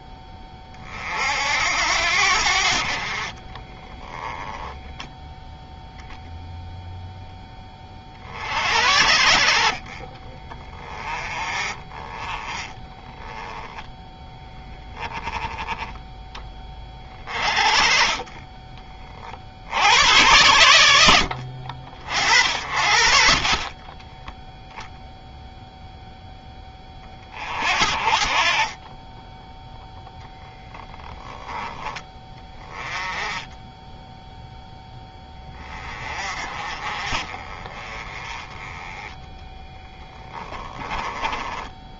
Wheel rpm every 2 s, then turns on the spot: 50, 50, 10, 0, 70, 20, 10, 10, 30, 20, 80, 50, 0, 30, 20, 0, 10, 10, 30, 10, 10.
10-14